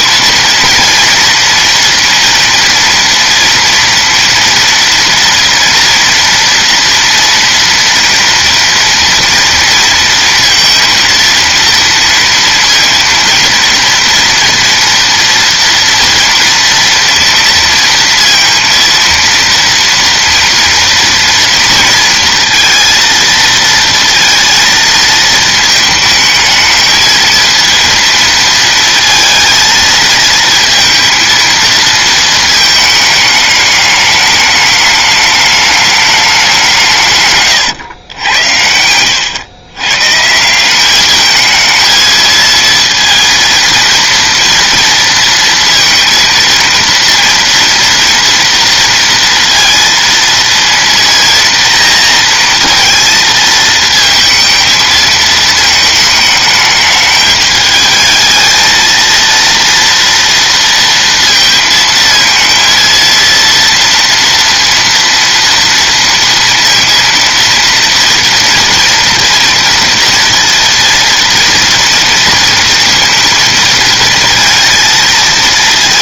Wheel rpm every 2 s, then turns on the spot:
230, 230, 230, 230, 230, 230, 230, 230, 230, 230, 230, 230, 230, 220, 230, 230, 220, 210, 170, 80, 190, 230, 230, 230, 230, 230, 230, 220, 210, 220, 230, 230, 230, 230, 240, 230, 230, 230.
none